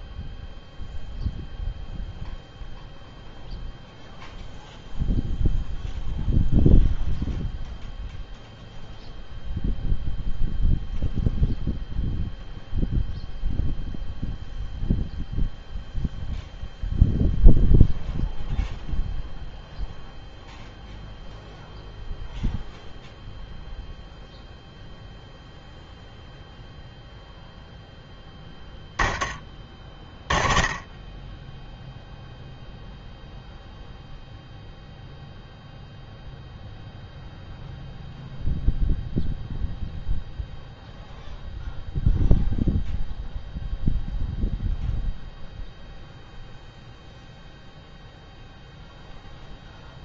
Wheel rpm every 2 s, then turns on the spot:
0, 0, 0, 0, 0, 0, 0, 0, 0, 0, 0, 0, 0, 0, 10, 20, 0, 0, 0, 0, 0, 0, 0, 0, 0.
none